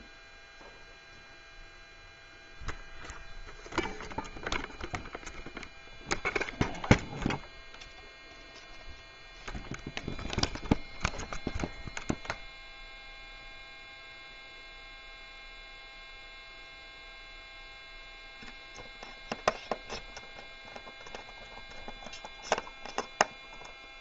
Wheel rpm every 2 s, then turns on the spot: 0, 0, 0, 0, 0, 0, 0, 0, 0, 0, 0, 0.
none